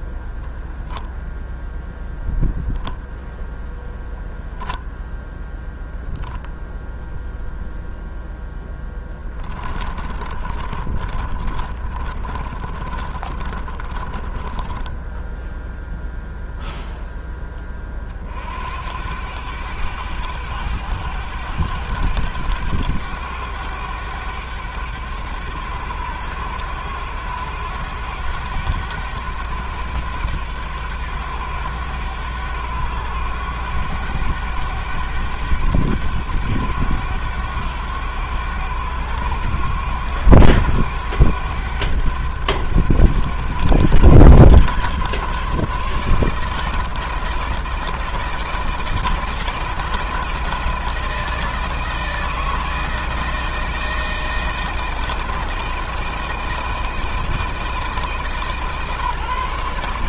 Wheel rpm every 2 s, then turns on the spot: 0, 0, 10, 0, 20, 30, 30, 0, 20, 100, 100, 100, 100, 100, 100, 100, 100, 100, 100, 100, 100, 100, 140, 160, 160, 170, 160, 160, 160, 150.
8-14